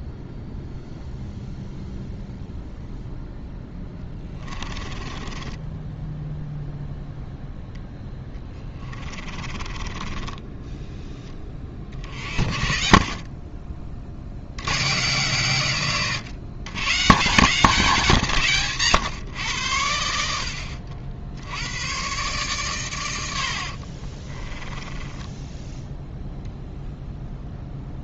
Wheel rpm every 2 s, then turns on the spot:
0, 0, 20, 0, 10, 10, 60, 100, 130, 170, 70, 130, 20, 0.
4-6 8-10 12-14 24-26